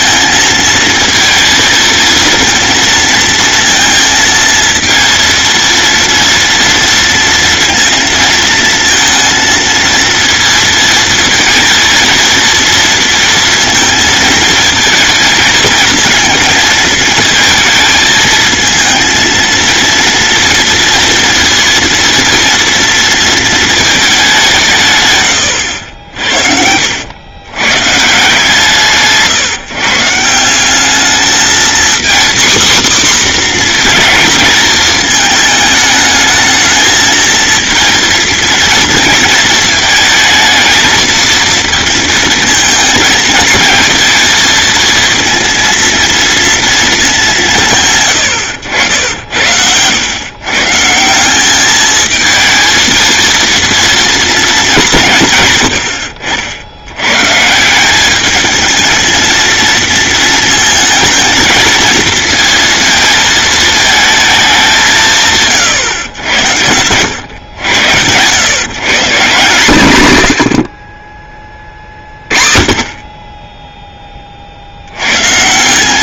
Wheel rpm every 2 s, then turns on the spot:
230, 230, 230, 230, 230, 230, 230, 230, 230, 230, 230, 230, 150, 80, 160, 200, 260, 220, 220, 230, 220, 220, 230, 230, 90, 150, 230, 190, 90, 220, 220, 220, 180, 100, 150, 40, 30, 80.
none